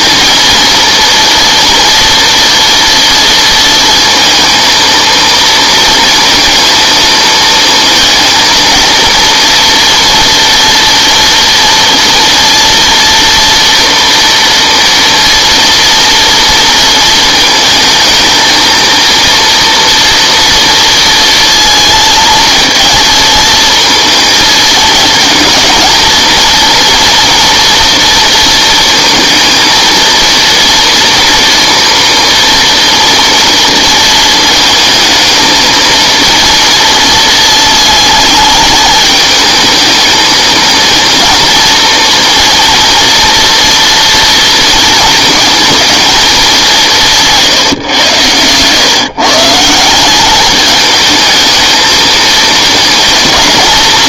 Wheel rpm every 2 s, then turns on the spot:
230, 230, 230, 230, 230, 240, 230, 230, 230, 220, 230, 230, 220, 230, 230, 230, 230, 220, 230, 220, 220, 230, 230, 210, 120, 200, 220.
none